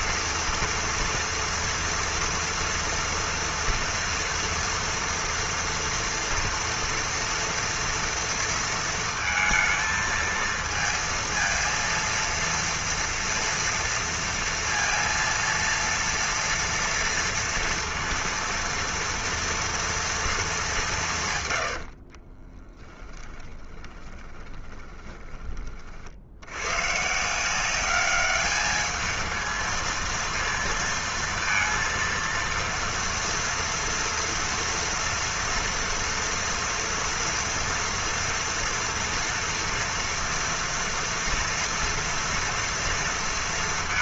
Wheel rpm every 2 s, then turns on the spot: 230, 230, 230, 230, 230, 230, 230, 230, 230, 230, 210, 20, 20, 90, 210, 230, 230, 230, 230, 230, 230, 230.
22-26